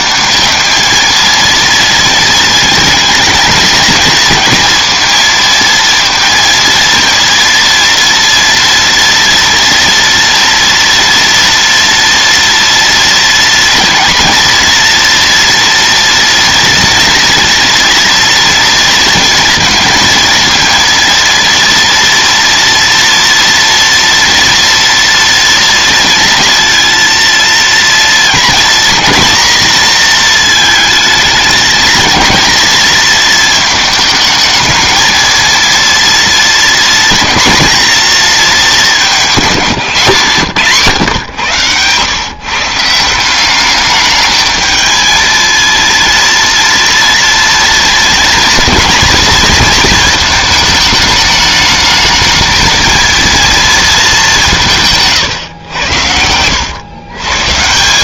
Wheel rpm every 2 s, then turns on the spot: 220, 230, 230, 230, 230, 230, 230, 240, 230, 230, 230, 230, 230, 230, 240, 220, 230, 220, 230, 190, 140, 160, 220, 230, 230, 220, 230, 150, 110.
none